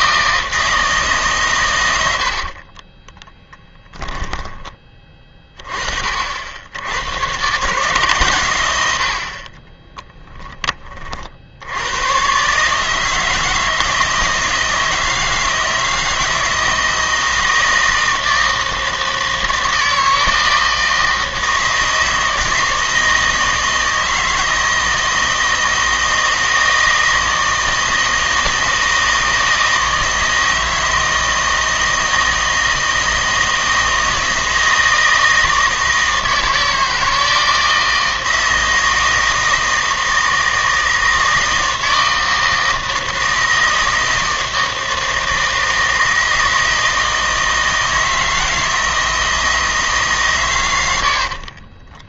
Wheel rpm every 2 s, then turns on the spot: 160, 40, 20, 80, 100, 20, 140, 160, 160, 160, 160, 160, 160, 160, 160, 160, 160, 160, 160, 160, 160, 160, 160, 160, 160, 110.
2-4